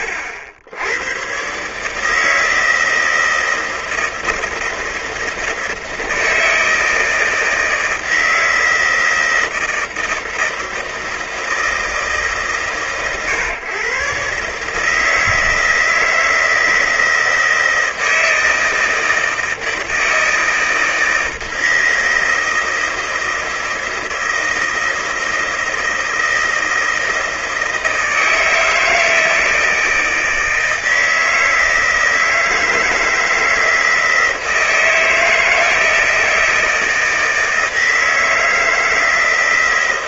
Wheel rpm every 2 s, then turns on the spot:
90, 160, 160, 160, 160, 160, 130, 150, 160, 160, 160, 160, 160, 160, 160, 160, 160, 160, 160, 160.
none